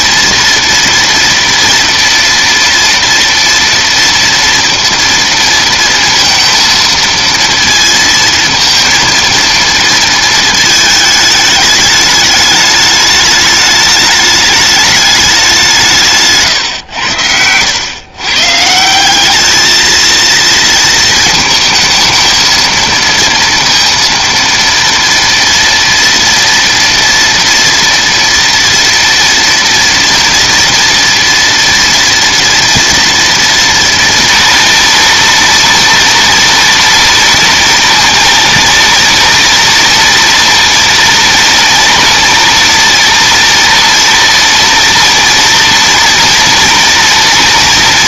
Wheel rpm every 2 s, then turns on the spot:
230, 230, 230, 230, 230, 220, 210, 210, 150, 120, 230, 230, 230, 230, 230, 230, 230, 230, 230, 230, 230, 230, 230, 230.
none